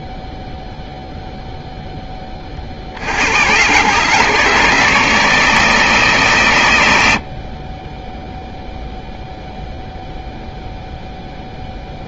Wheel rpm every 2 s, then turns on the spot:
0, 50, 150, 110, 0, 0.
none